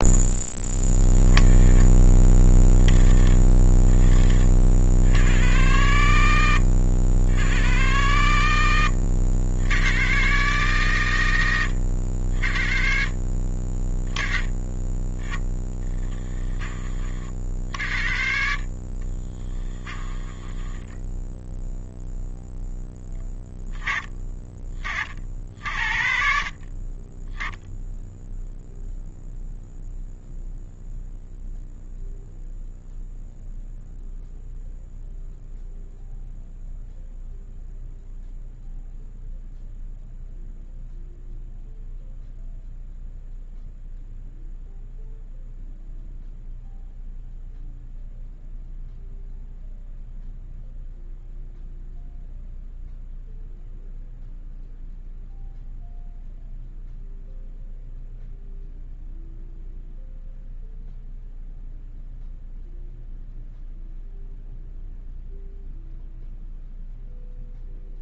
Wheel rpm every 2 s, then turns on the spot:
20, 30, 100, 90, 90, 100, 40, 10, 50, 30, 10, 20, 50, 10, 0, 0, 0, 0, 0, 0, 0, 0, 0, 0, 0, 0, 0, 0, 0, 0, 0, 0, 0, 0.
18-20